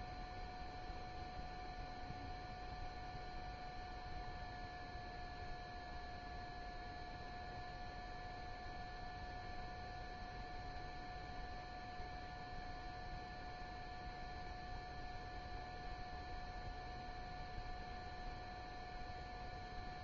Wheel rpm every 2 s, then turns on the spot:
0, 0, 0, 0, 0, 0, 0, 0, 0, 0.
none